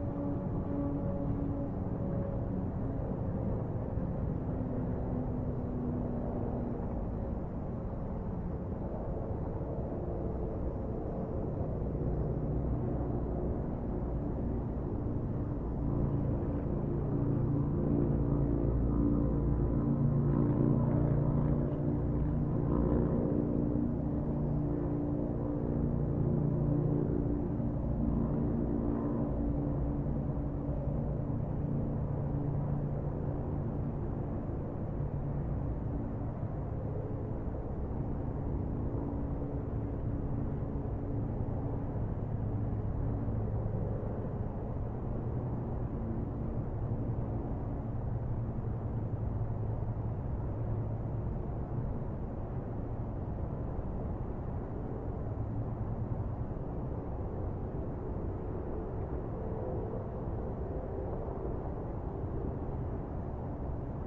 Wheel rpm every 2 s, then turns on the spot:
0, 0, 0, 0, 0, 0, 0, 0, 0, 0, 0, 0, 0, 0, 0, 0, 0, 0, 0, 0, 0, 0, 0, 0, 0, 0, 0, 0, 0, 0, 0, 0.
none